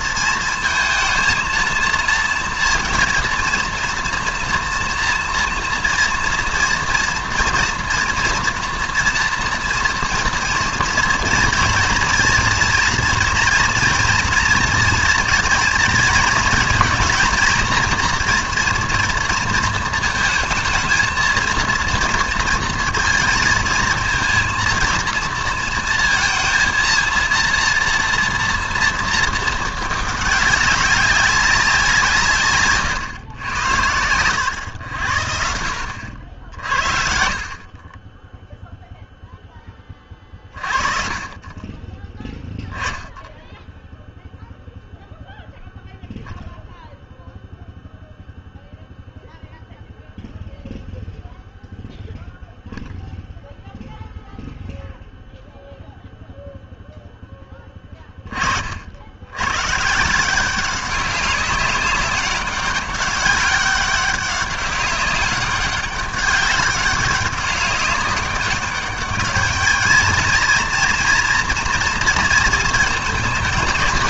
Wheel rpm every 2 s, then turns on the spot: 220, 230, 230, 230, 230, 230, 230, 230, 230, 240, 220, 230, 230, 230, 230, 200, 140, 100, 50, 0, 40, 10, 0, 0, 0, 0, 0, 0, 0, 60, 190, 200, 200, 190, 200, 230, 220.
32-34